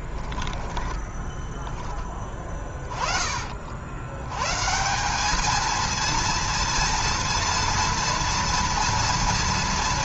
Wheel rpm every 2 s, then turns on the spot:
20, 30, 140, 230, 230.
0-2